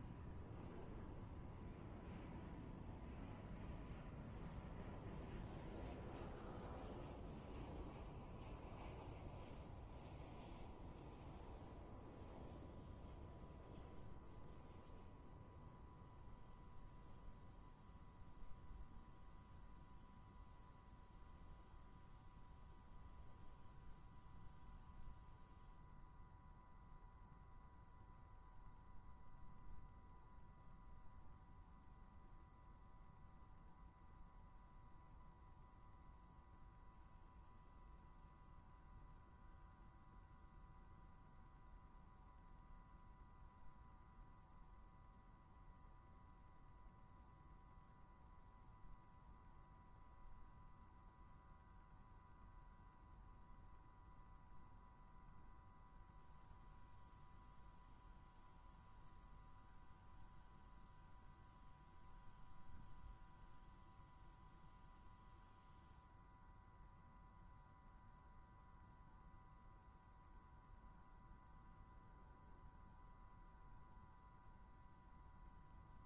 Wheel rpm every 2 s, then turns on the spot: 120, 120, 120, 120, 120, 120, 120, 120, 120, 120, 120, 120, 120, 120, 120, 120, 120, 120, 120, 120, 120, 120, 120, 120, 120, 120, 110, 120, 120, 120, 120, 120, 120, 120, 120, 120, 120, 120.
none